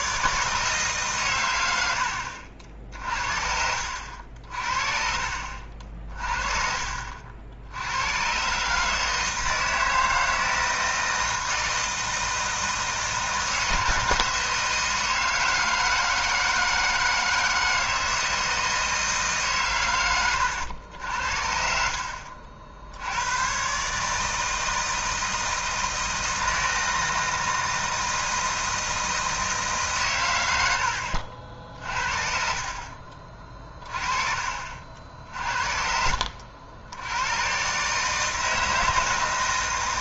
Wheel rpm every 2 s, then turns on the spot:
150, 60, 50, 50, 150, 160, 160, 160, 160, 160, 80, 70, 160, 160, 160, 90, 40, 50, 70, 160.
none